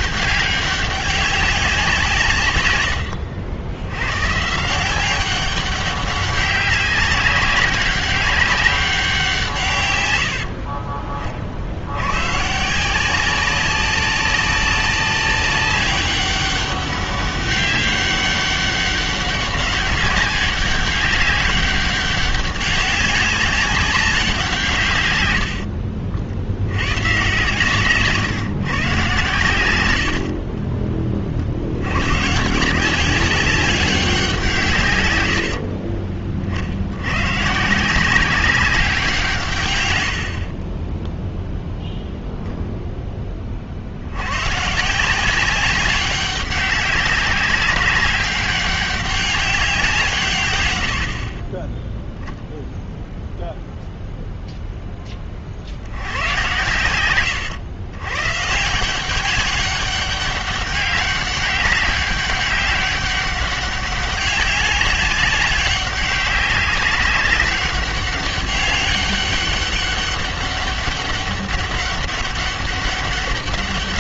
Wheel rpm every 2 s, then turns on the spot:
200, 90, 180, 200, 190, 50, 170, 200, 200, 200, 200, 190, 120, 110, 130, 30, 170, 120, 90, 180, 20, 0, 160, 200, 200, 80, 0, 10, 100, 180, 200, 200, 200, 190, 200, 200, 200.
40-42